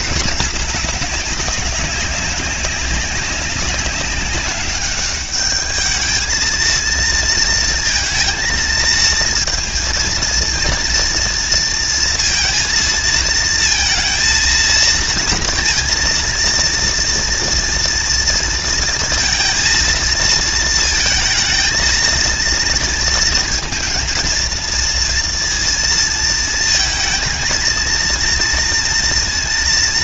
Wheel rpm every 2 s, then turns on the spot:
210, 200, 200, 230, 230, 230, 230, 230, 230, 230, 230, 230, 230, 220, 230.
none